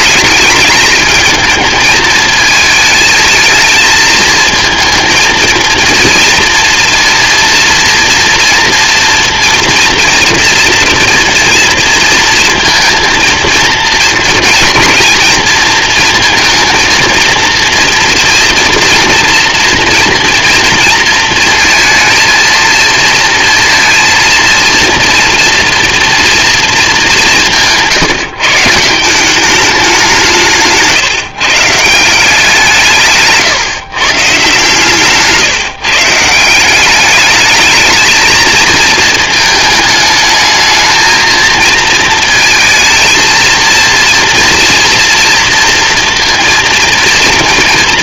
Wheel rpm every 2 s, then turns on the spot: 210, 220, 230, 240, 230, 230, 230, 230, 230, 230, 230, 230, 230, 230, 160, 160, 170, 140, 180, 220, 210, 230, 240, 230.
none